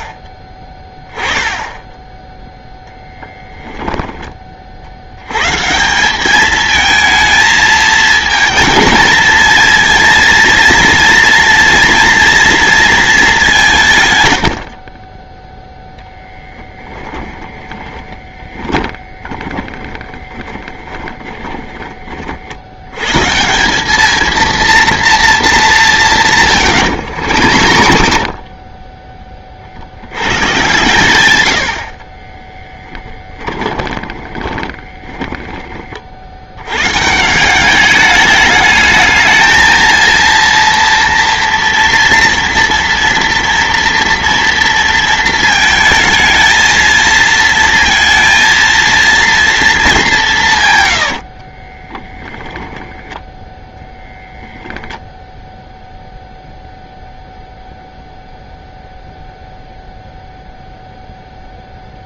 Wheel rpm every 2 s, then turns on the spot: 10, 0, 70, 220, 220, 230, 220, 40, 10, 20, 10, 110, 230, 110, 30, 130, 20, 30, 130, 220, 230, 230, 230, 220, 230, 120, 10, 0, 0, 0, 0.
16-22 26-30 32-36 50-54